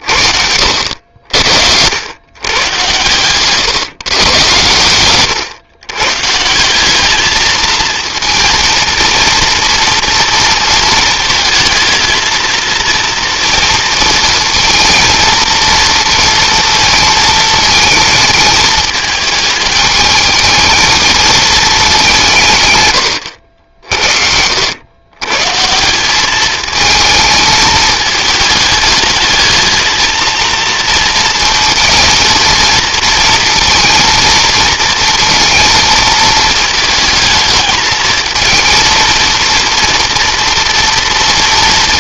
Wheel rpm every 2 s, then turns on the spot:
70, 110, 120, 190, 230, 220, 230, 230, 230, 220, 220, 130, 100, 220, 210, 230, 230, 230, 220, 230, 220.
4-6